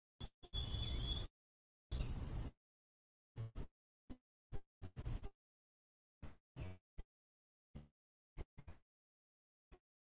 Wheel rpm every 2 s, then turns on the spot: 0, 0, 0, 0, 0.
none